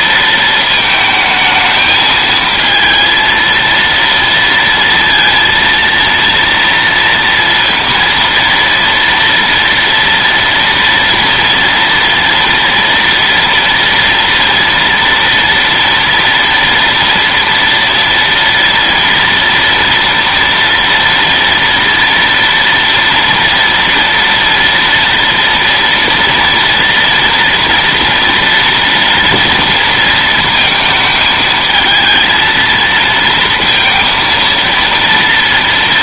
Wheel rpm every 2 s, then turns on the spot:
220, 220, 230, 230, 230, 230, 230, 230, 230, 230, 230, 230, 230, 230, 230, 220, 230, 230.
none